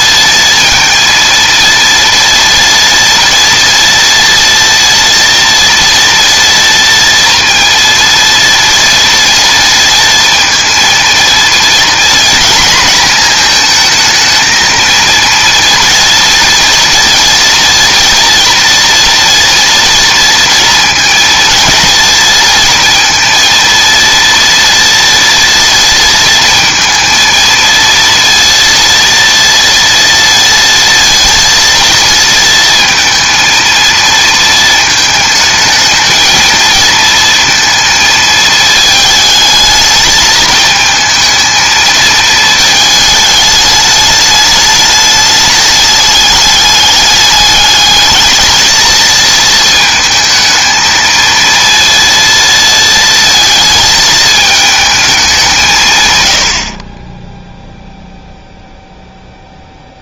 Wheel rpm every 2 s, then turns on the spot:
230, 230, 230, 230, 230, 230, 240, 230, 230, 230, 230, 230, 230, 220, 230, 230, 230, 220, 220, 220, 220, 220, 210, 200, 220, 220, 230, 220, 80, 0.
none